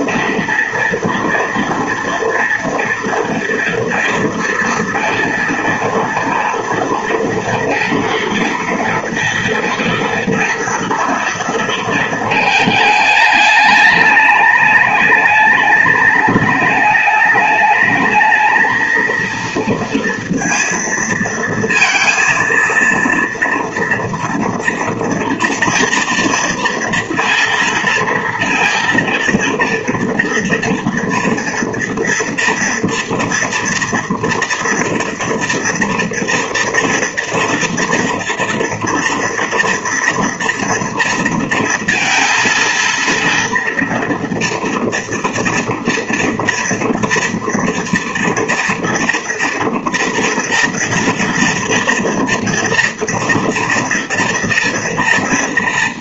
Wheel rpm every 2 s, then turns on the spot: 230, 230, 230, 230, 230, 230, 220, 210, 210, 220, 230, 230, 230, 230, 230, 230, 230, 230, 230, 230, 230, 230, 230, 230, 230, 230, 230, 230.
none